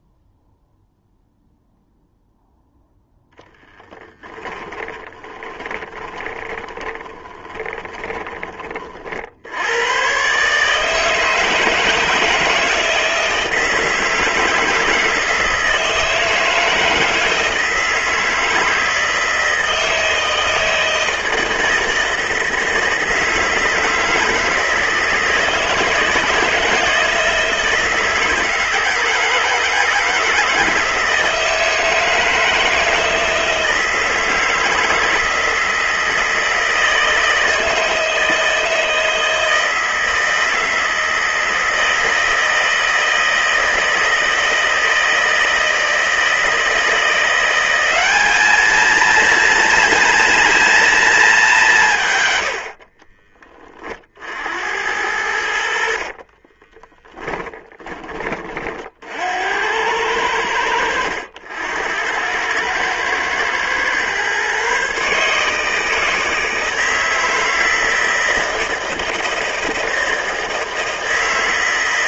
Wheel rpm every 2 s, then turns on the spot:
0, 0, 20, 20, 40, 150, 160, 160, 160, 160, 160, 160, 160, 160, 160, 160, 160, 160, 160, 160, 160, 160, 160, 170, 220, 230, 60, 80, 20, 50, 80, 110, 140, 160, 160, 160.
4-8 56-58